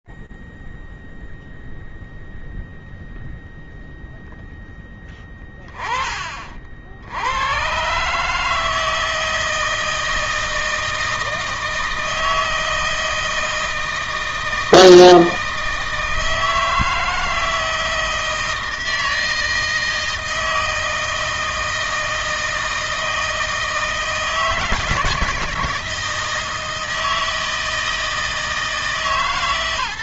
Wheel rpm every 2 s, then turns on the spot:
0, 0, 0, 20, 90, 160, 160, 160, 160, 160, 160, 160, 160, 160, 160.
none